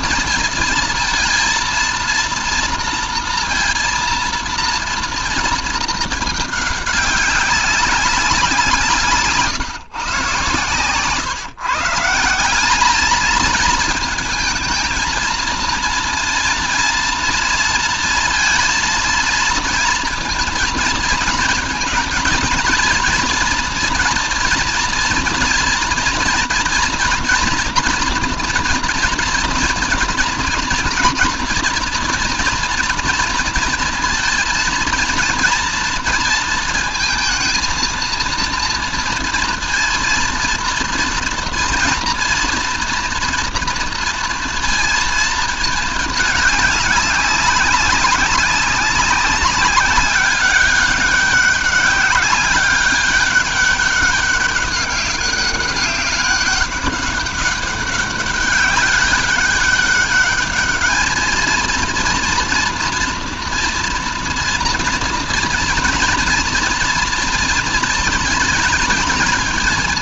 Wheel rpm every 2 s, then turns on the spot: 230, 230, 230, 210, 180, 120, 180, 230, 230, 230, 230, 230, 230, 230, 230, 230, 230, 230, 230, 230, 230, 230, 230, 210, 190, 200, 200, 200, 200, 190, 210, 230, 230, 230, 220.
10-12